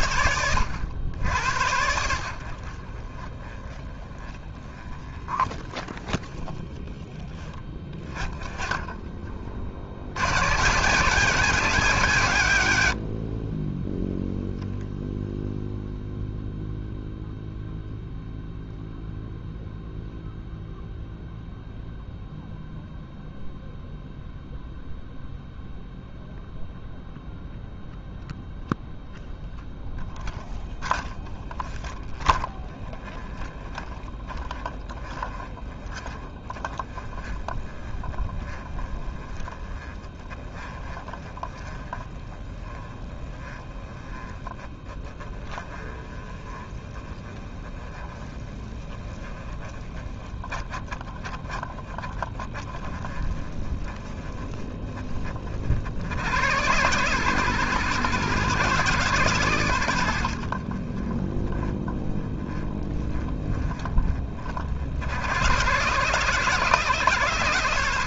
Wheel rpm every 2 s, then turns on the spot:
90, 30, 20, 40, 40, 170, 50, 0, 0, 0, 0, 0, 0, 0, 0, 20, 20, 30, 20, 20, 20, 20, 20, 20, 10, 20, 20, 20, 100, 120, 30, 30, 40, 120.
none